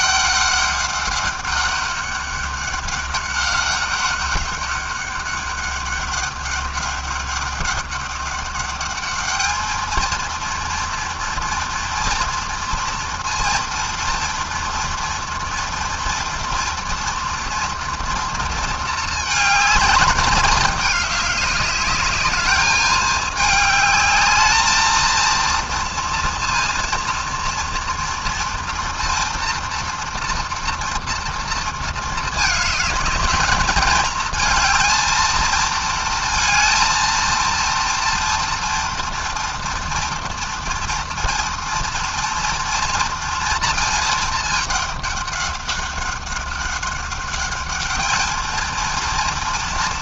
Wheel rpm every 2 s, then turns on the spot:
200, 200, 200, 200, 210, 230, 230, 230, 230, 220, 200, 210, 230, 230, 230, 230, 210, 230, 230, 240, 230, 230, 200, 200, 230.
none